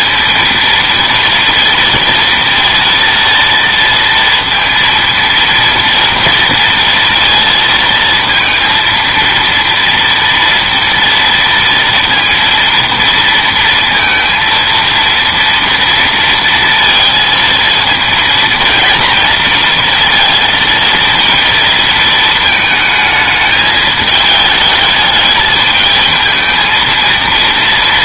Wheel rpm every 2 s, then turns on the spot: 230, 230, 230, 230, 230, 230, 230, 230, 230, 230, 230, 220, 220, 230.
none